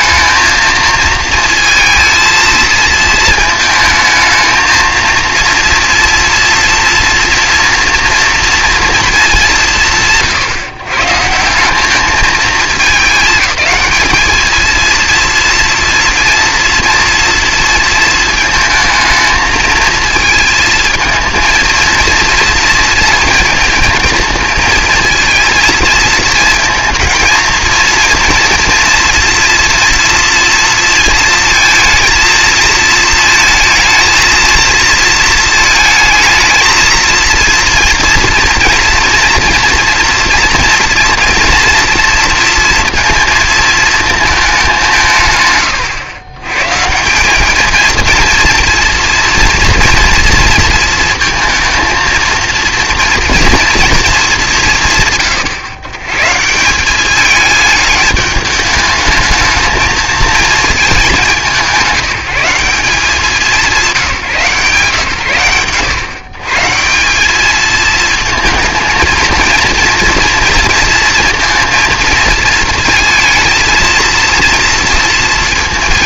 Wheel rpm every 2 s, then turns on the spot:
230, 220, 230, 230, 220, 130, 220, 230, 230, 220, 230, 230, 230, 220, 230, 230, 220, 230, 230, 230, 240, 230, 180, 160, 230, 230, 230, 150, 200, 210, 210, 190, 140, 160, 230, 230, 230, 230.
none